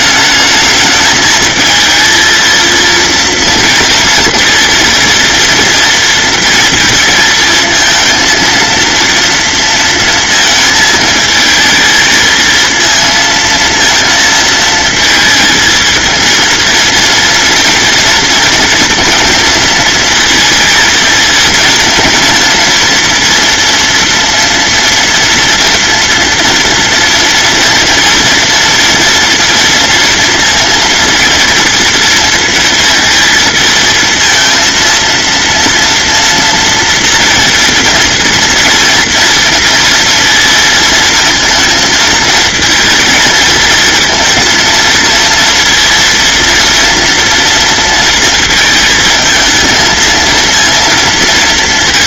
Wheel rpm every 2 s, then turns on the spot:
220, 230, 230, 230, 230, 230, 230, 230, 230, 230, 220, 230, 240, 240, 230, 230, 230, 230, 230, 230, 230, 230, 230, 230, 220, 230.
none